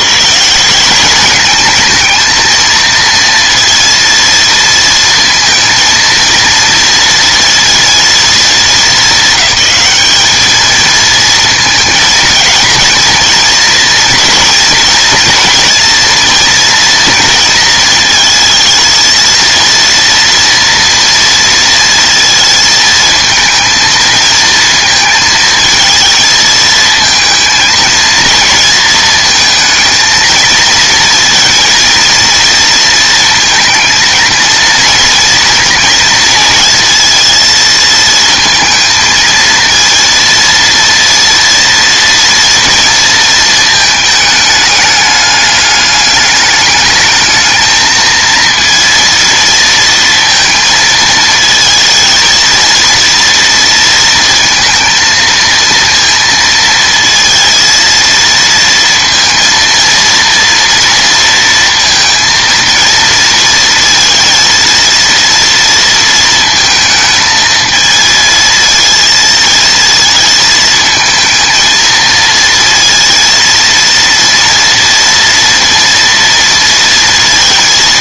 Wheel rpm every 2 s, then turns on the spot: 190, 230, 230, 230, 220, 220, 220, 230, 230, 230, 230, 220, 230, 230, 220, 230, 230, 230, 230, 230, 230, 230, 210, 210, 230, 230, 230, 230, 230, 230, 230, 230, 230, 220, 230, 220, 230, 230, 230.
none